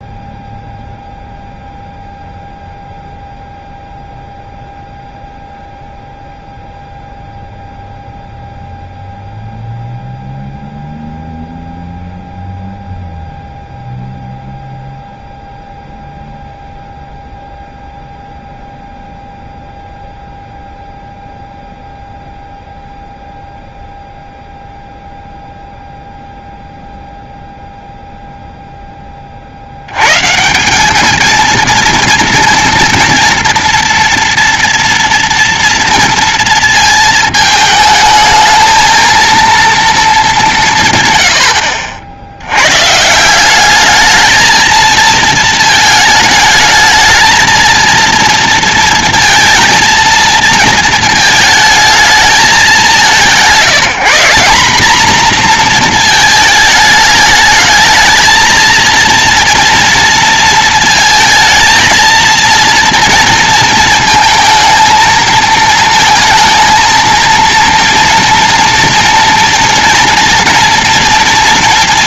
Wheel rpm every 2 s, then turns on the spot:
0, 0, 0, 0, 0, 0, 0, 0, 0, 0, 0, 0, 0, 0, 0, 170, 230, 230, 230, 220, 170, 100, 220, 210, 230, 220, 210, 210, 220, 220, 230, 230, 230, 220, 230, 240.
none